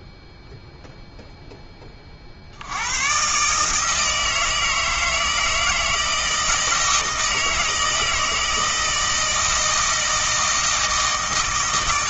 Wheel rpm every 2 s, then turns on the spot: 0, 100, 160, 160, 160, 160.
none